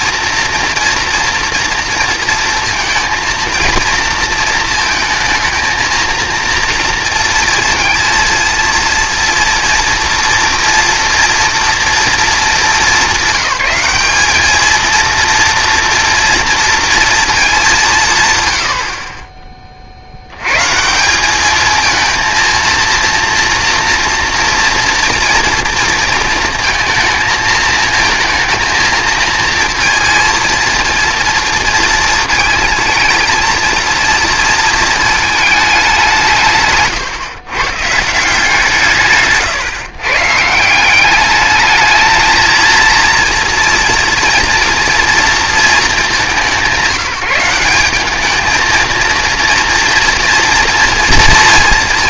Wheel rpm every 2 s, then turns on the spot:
230, 230, 230, 230, 230, 230, 210, 220, 230, 90, 130, 230, 230, 230, 230, 230, 230, 230, 140, 150, 170, 230, 230, 180, 230, 230.
none